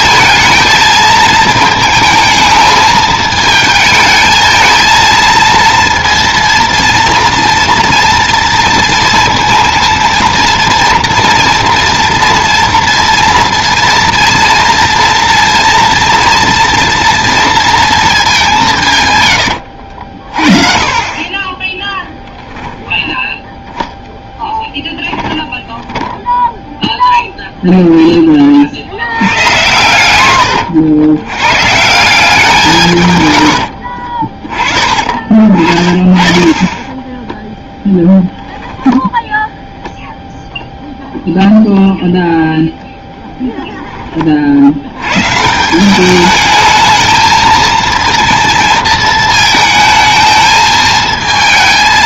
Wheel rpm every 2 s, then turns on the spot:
220, 220, 230, 230, 230, 230, 230, 230, 230, 150, 40, 20, 10, 0, 70, 80, 160, 30, 10, 10, 0, 0, 100, 220, 220, 220.
20-22 24-26 38-40